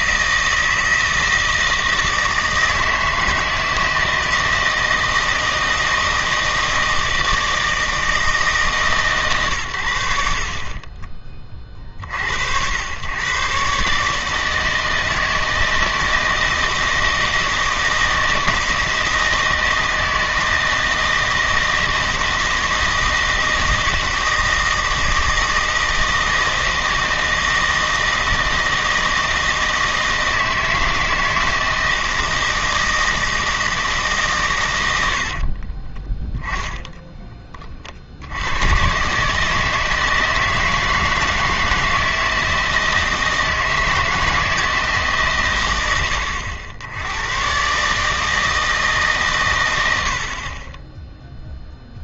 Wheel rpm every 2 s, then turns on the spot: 160, 160, 160, 160, 150, 50, 90, 160, 160, 160, 160, 160, 160, 160, 160, 160, 160, 120, 10, 100, 160, 160, 160, 90, 160, 30.
36-38